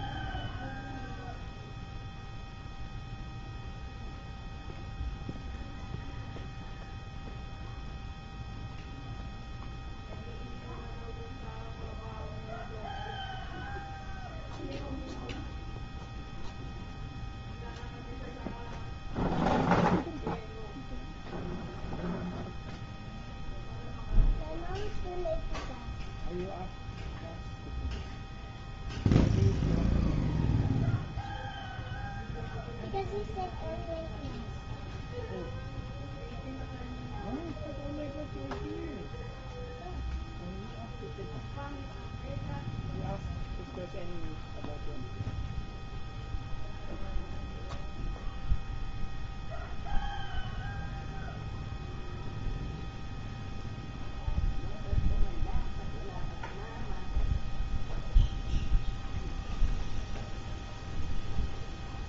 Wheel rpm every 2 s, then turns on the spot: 0, 0, 0, 0, 0, 0, 0, 0, 0, 0, 0, 0, 0, 0, 0, 0, 0, 0, 0, 0, 0, 0, 0, 0, 0, 0, 0, 0, 0, 0, 0.
none